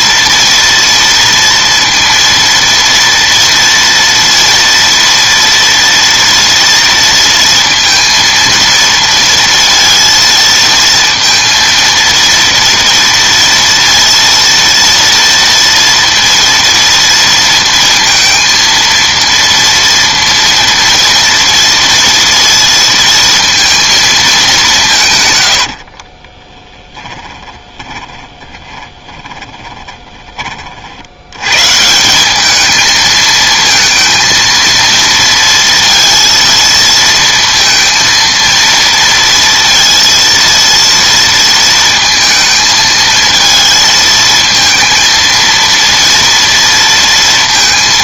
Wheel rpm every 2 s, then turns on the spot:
240, 230, 230, 230, 230, 230, 230, 230, 230, 230, 230, 230, 200, 20, 20, 40, 210, 230, 230, 230, 230, 220, 220, 230.
26-30